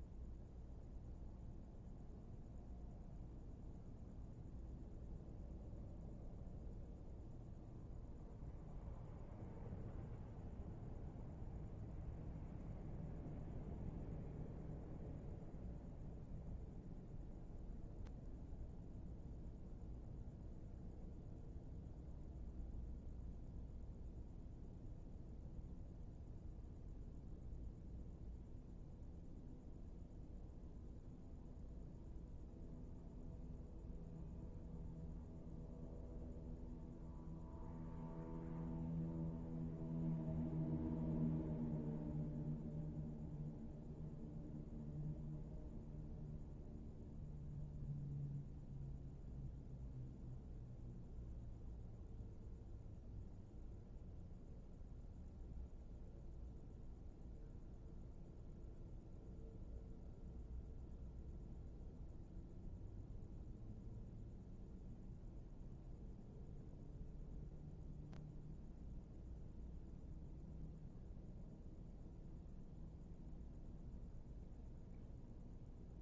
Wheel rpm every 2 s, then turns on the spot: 0, 0, 0, 0, 0, 0, 0, 0, 0, 0, 0, 0, 0, 0, 0, 0, 0, 0, 0, 0, 0, 0, 0, 0, 0, 0, 0, 0, 0, 0, 0, 0, 0, 0, 0, 0, 0, 0.
none